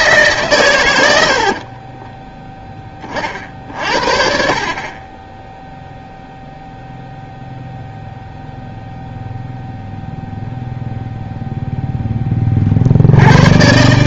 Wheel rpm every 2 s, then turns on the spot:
120, 10, 40, 0, 0, 0, 40.
none